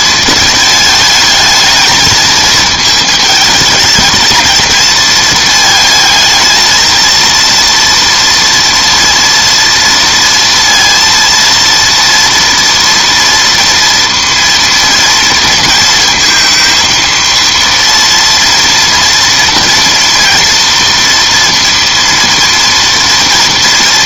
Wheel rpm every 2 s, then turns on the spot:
220, 220, 220, 230, 230, 230, 230, 230, 220, 230, 230, 230.
none